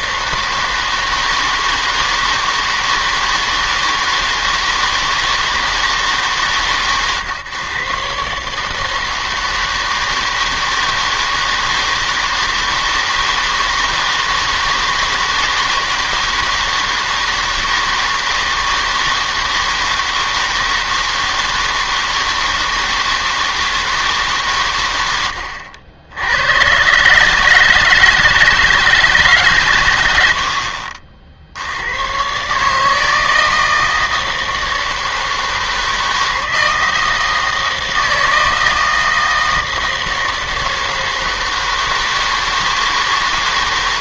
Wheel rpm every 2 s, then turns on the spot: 160, 160, 160, 140, 150, 160, 160, 160, 160, 160, 160, 160, 130, 100, 160, 70, 140, 160, 160, 160, 160, 160.
none